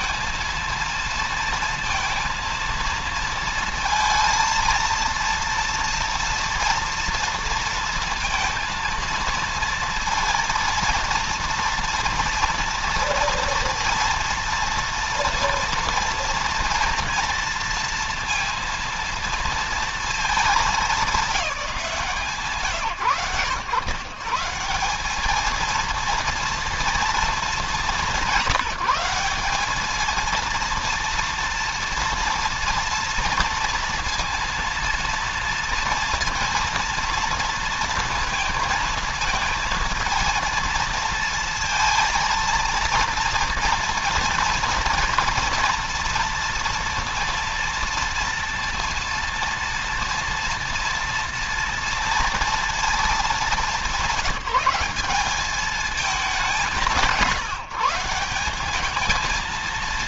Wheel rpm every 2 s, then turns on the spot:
230, 230, 230, 230, 230, 230, 230, 230, 230, 230, 210, 110, 190, 230, 190, 230, 230, 230, 230, 230, 230, 230, 230, 230, 230, 230, 220, 200, 170, 210.
none